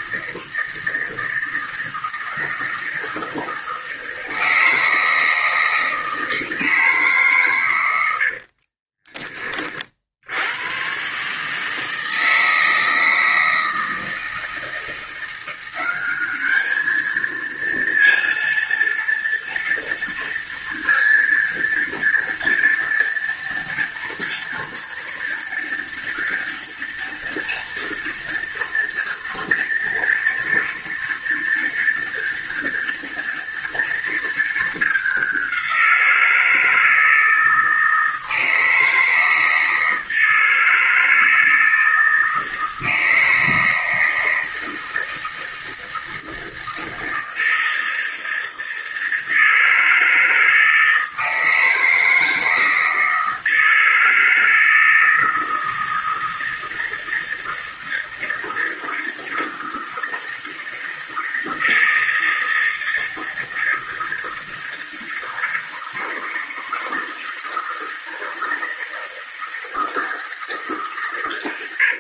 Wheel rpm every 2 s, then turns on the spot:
160, 160, 160, 150, 30, 130, 160, 170, 220, 230, 230, 230, 240, 230, 230, 230, 230, 200, 160, 160, 160, 160, 160, 160, 160, 160, 160, 160, 160, 160, 160, 160, 160, 160, 160, 140.
8-10